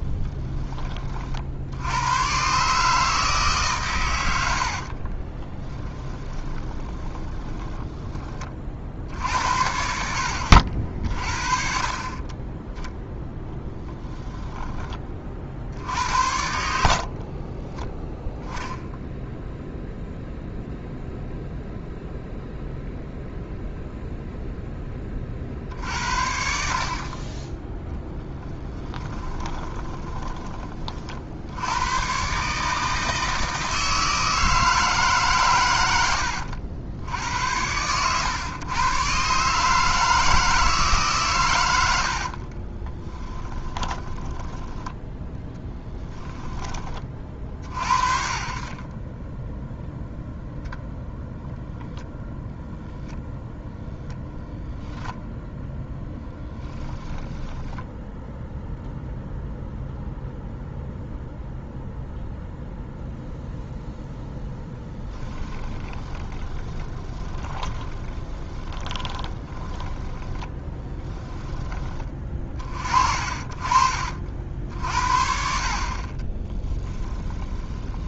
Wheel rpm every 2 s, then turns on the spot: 20, 150, 60, 20, 50, 60, 10, 20, 70, 0, 0, 0, 10, 50, 20, 30, 160, 160, 80, 120, 150, 30, 10, 20, 20, 0, 0, 0, 10, 0, 0, 0, 10, 20, 20, 10, 40, 50, 10.
4-8 28-30 42-44 64-72 76-78